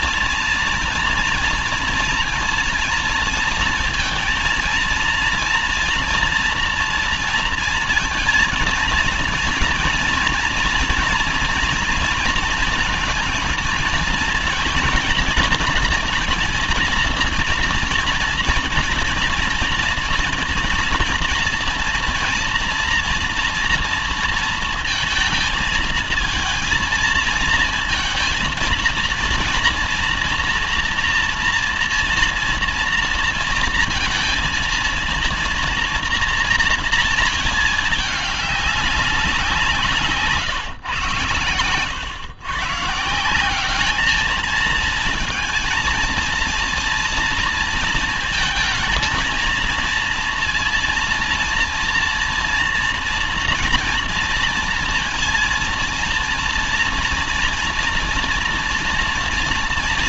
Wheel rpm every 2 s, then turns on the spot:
230, 230, 230, 230, 220, 230, 230, 230, 230, 230, 230, 230, 230, 220, 230, 230, 230, 230, 230, 210, 140, 130, 220, 230, 230, 230, 230, 230, 230, 240.
none